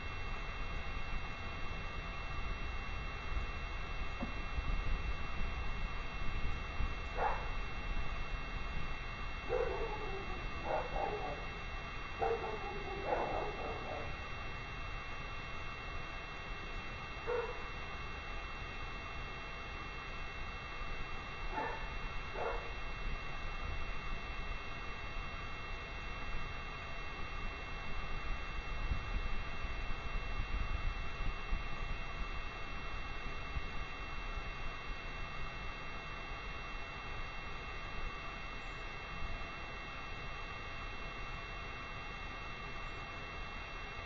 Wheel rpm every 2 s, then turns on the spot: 0, 0, 0, 0, 0, 0, 0, 0, 0, 0, 0, 0, 0, 0, 0, 0, 0, 0, 0, 0, 0, 0.
none